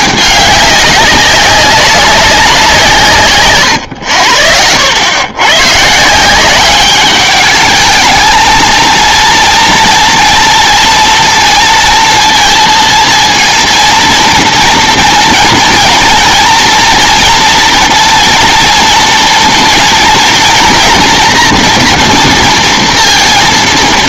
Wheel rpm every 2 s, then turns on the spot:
200, 170, 80, 200, 230, 230, 230, 230, 230, 230, 230, 230.
none